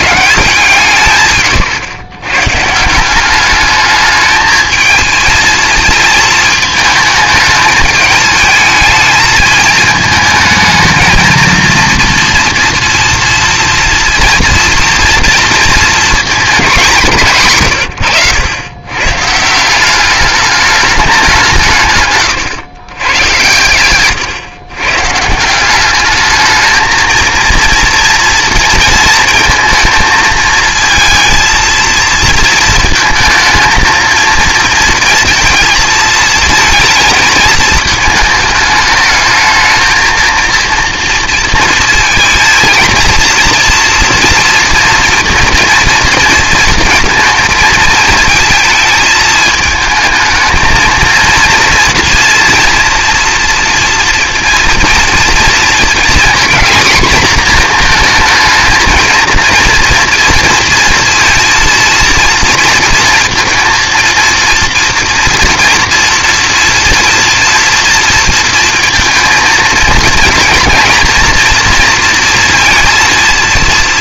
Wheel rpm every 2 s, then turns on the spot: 170, 150, 220, 220, 220, 220, 240, 240, 210, 100, 210, 130, 120, 220, 230, 220, 230, 220, 230, 220, 230, 230, 230, 230, 230, 220, 230, 230, 240, 230, 230, 230, 230, 230, 230, 230, 230.
none